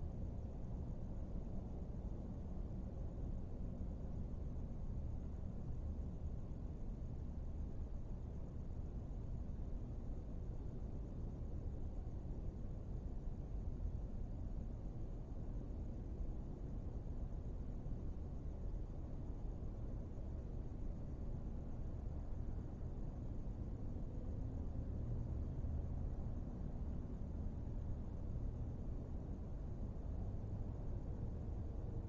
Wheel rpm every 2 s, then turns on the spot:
0, 0, 0, 0, 0, 0, 0, 0, 0, 0, 0, 0, 0, 0, 0, 0.
none